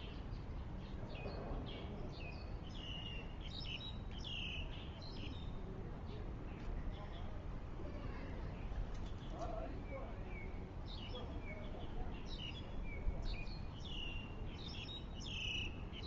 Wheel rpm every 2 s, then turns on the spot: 0, 0, 0, 0, 0, 0, 0, 0.
none